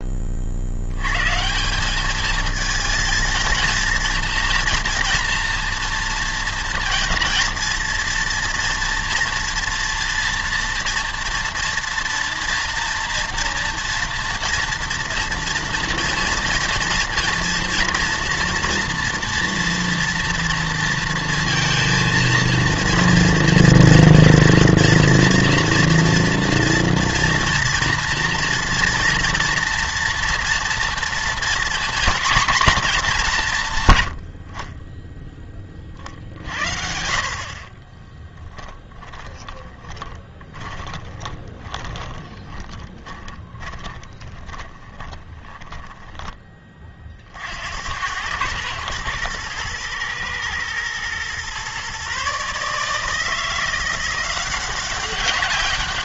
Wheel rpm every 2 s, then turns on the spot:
80, 220, 230, 230, 240, 230, 230, 230, 230, 230, 230, 230, 240, 230, 230, 240, 240, 30, 60, 20, 20, 20, 20, 30, 110, 120, 150, 180.
38-46